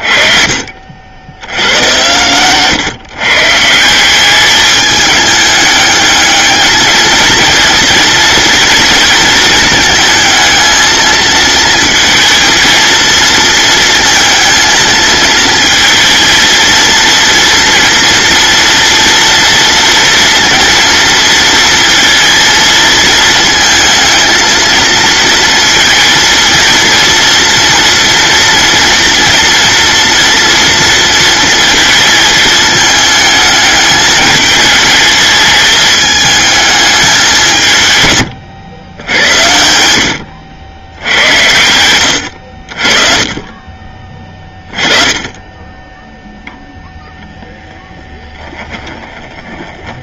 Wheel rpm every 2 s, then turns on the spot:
50, 130, 210, 220, 230, 220, 230, 220, 230, 230, 230, 230, 230, 230, 230, 230, 220, 220, 220, 110, 90, 50, 20, 0, 10.
none